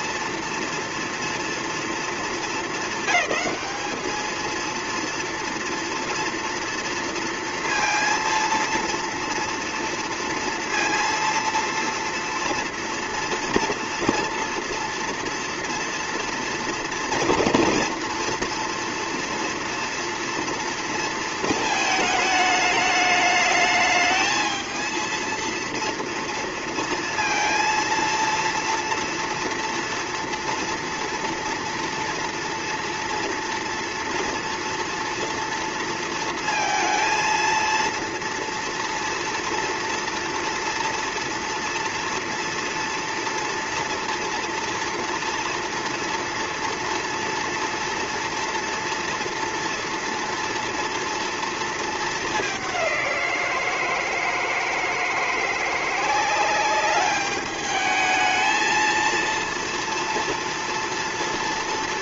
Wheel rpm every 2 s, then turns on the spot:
230, 200, 230, 230, 230, 230, 230, 230, 230, 230, 230, 210, 220, 230, 230, 230, 230, 230, 230, 230, 230, 230, 240, 230, 230, 230, 190, 160, 200, 220, 230.
none